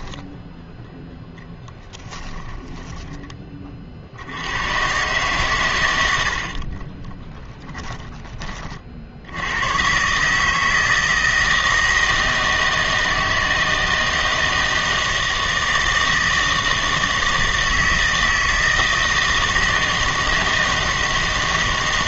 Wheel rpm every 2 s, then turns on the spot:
0, 10, 110, 40, 30, 160, 160, 160, 160, 160, 160.
2-4 6-8